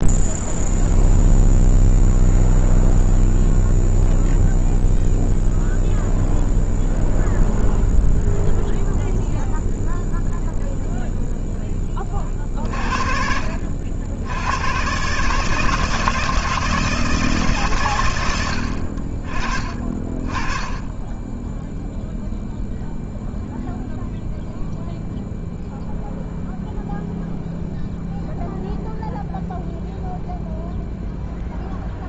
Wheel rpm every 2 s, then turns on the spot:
0, 0, 0, 0, 0, 0, 40, 100, 160, 80, 20, 0, 0, 0, 0, 0.
none